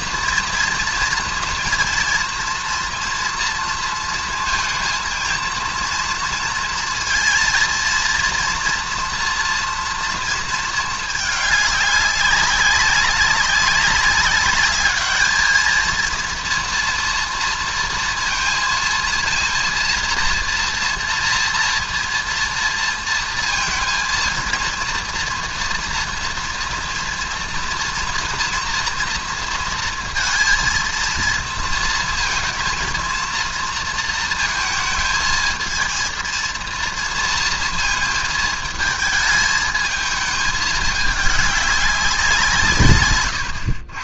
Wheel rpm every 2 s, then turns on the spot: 230, 230, 230, 230, 230, 230, 200, 200, 230, 230, 230, 230, 230, 240, 230, 230, 230, 230, 230, 230, 220, 190.
none